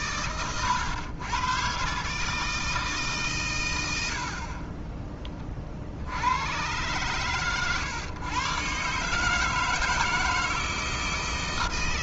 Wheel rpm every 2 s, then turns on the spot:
110, 160, 30, 110, 130, 160.
none